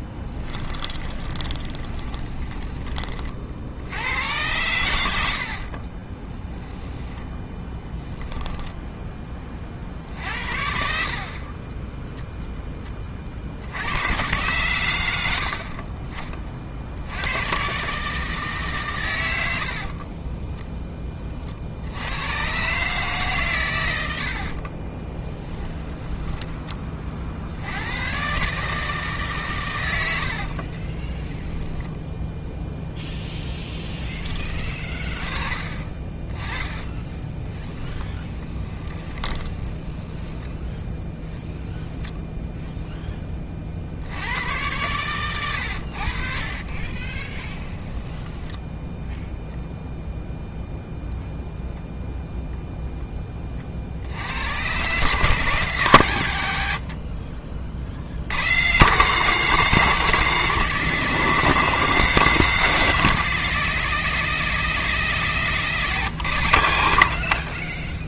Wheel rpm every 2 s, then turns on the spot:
10, 20, 100, 10, 10, 60, 10, 110, 40, 140, 10, 130, 40, 20, 150, 50, 0, 20, 20, 20, 10, 0, 110, 50, 10, 0, 0, 120, 80, 130, 180, 170, 170, 90.
0-2 6-8 20-22 24-26 30-32 36-40 46-50 56-58